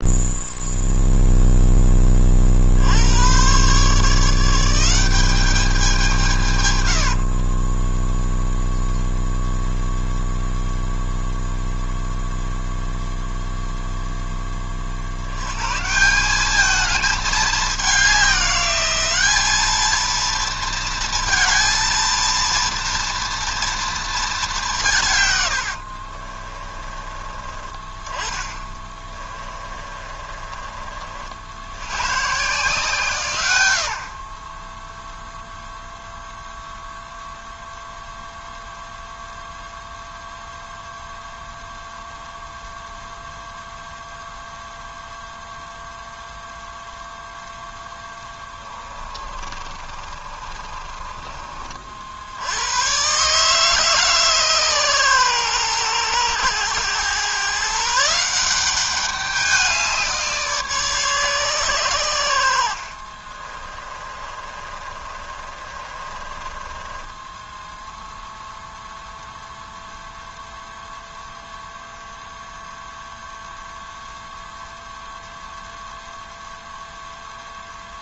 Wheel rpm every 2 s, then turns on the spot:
0, 90, 190, 60, 0, 0, 0, 60, 210, 200, 230, 230, 140, 30, 20, 50, 150, 0, 0, 0, 0, 0, 0, 0, 30, 30, 130, 120, 120, 200, 140, 40, 30, 10, 0, 0, 0, 0, 0.
6-8 28-30 48-52 62-68